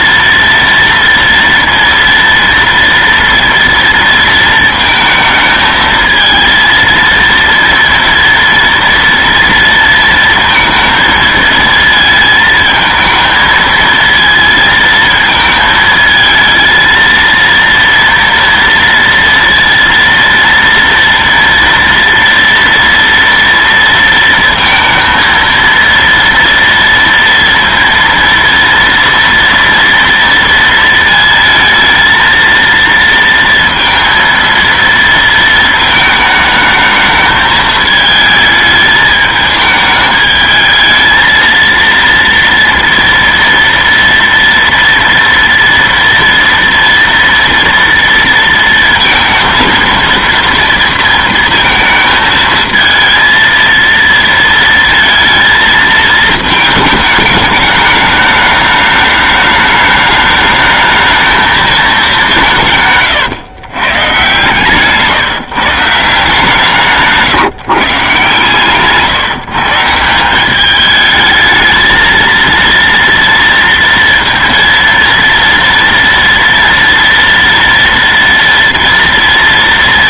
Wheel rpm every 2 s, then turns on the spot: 230, 230, 230, 220, 230, 230, 220, 230, 220, 230, 230, 230, 230, 230, 230, 230, 230, 230, 220, 220, 220, 230, 230, 230, 230, 230, 220, 230, 220, 210, 210, 180, 130, 160, 140, 180, 230, 230, 230, 230.
none